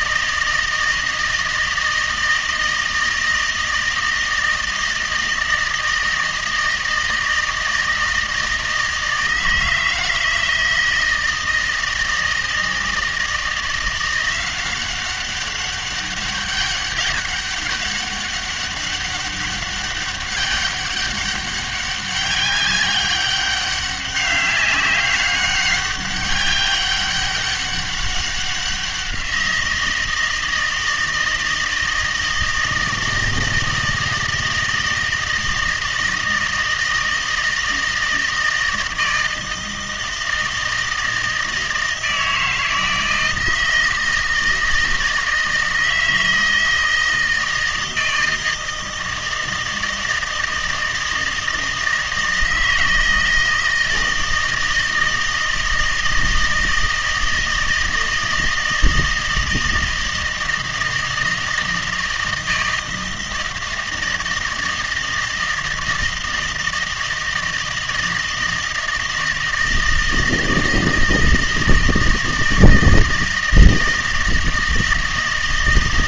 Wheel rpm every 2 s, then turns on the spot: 160, 160, 160, 160, 160, 160, 160, 180, 200, 200, 200, 200, 190, 190, 190, 160, 160, 160, 160, 160, 160, 160, 160, 160, 160, 160, 160, 160, 160, 160, 160, 160, 160, 160, 160, 160, 160, 160.
none